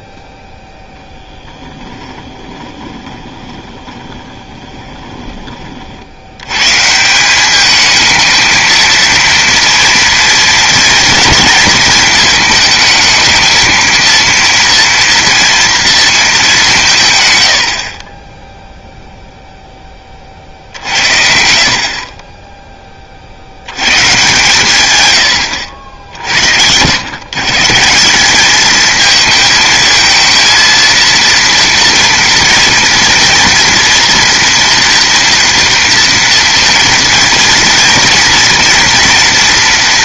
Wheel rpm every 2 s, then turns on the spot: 0, 20, 20, 120, 230, 230, 220, 230, 190, 0, 60, 10, 130, 80, 210, 230, 230, 230, 230, 230.
2-6